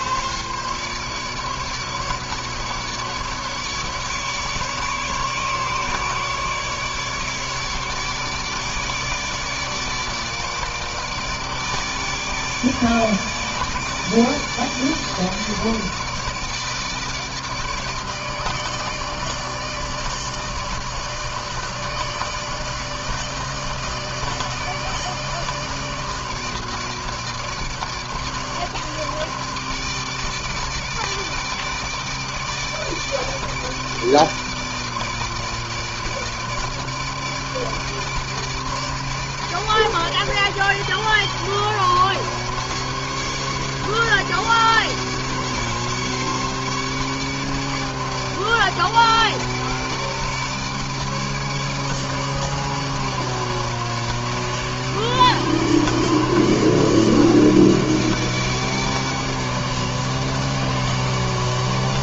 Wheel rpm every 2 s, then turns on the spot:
150, 150, 140, 150, 150, 150, 150, 150, 150, 150, 160, 160, 160, 150, 160, 150, 150, 150, 150, 150, 150, 150, 150, 150, 150, 150, 150, 150, 150, 150, 150.
none